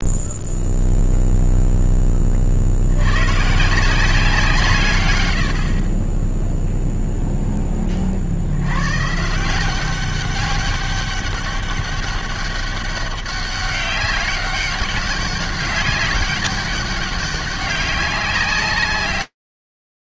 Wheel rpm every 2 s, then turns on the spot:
0, 80, 130, 0, 110, 200, 200, 200, 200, 120.
none